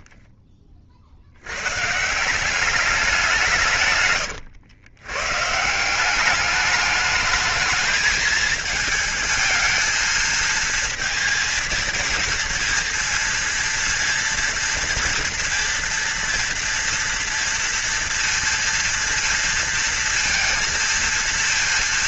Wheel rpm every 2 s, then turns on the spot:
40, 180, 120, 200, 220, 220, 230, 230, 230, 230, 230.
0-2 4-6